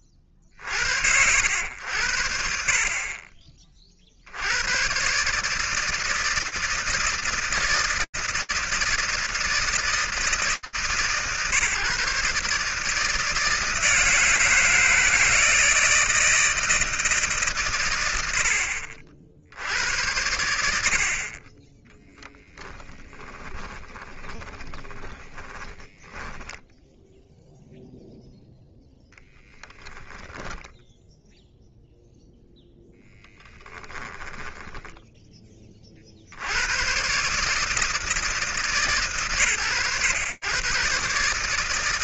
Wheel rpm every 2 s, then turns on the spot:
50, 50, 100, 160, 160, 140, 160, 160, 160, 70, 60, 10, 30, 10, 0, 0, 10, 30, 160, 100, 150.
22-26 32-34